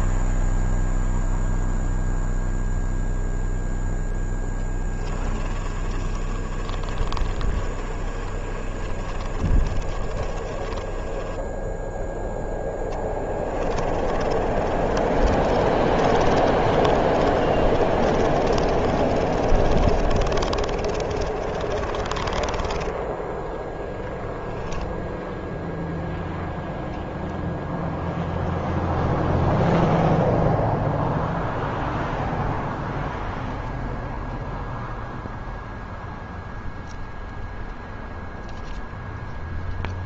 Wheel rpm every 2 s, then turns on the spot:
0, 0, 10, 30, 30, 20, 20, 40, 30, 30, 30, 10, 0, 0, 0, 0, 0, 0, 0, 0.
4-24